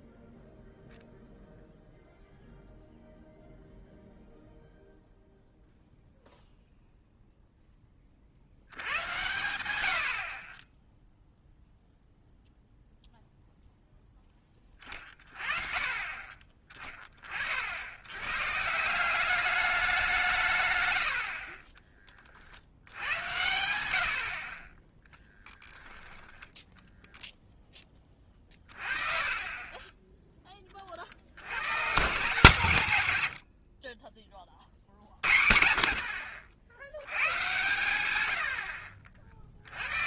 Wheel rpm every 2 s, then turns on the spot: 0, 0, 0, 0, 80, 20, 0, 20, 20, 140, 130, 50, 30, 10, 30, 20, 150, 50, 70, 70.
none